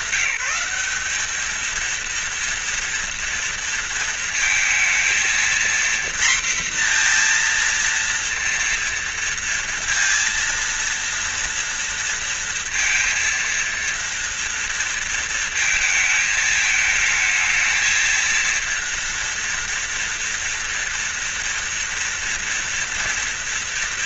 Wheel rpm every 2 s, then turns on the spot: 200, 230, 230, 240, 230, 230, 230, 230, 220, 230, 240, 230.
none